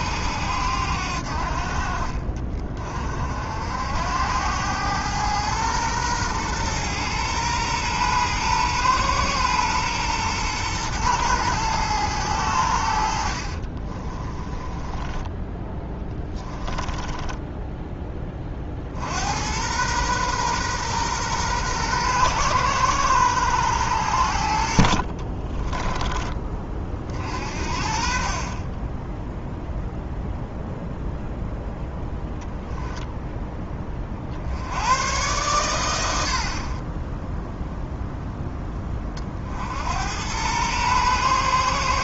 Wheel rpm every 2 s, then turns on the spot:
80, 40, 100, 120, 120, 110, 80, 20, 20, 50, 120, 110, 60, 30, 20, 0, 0, 100, 30, 20, 120.
14-18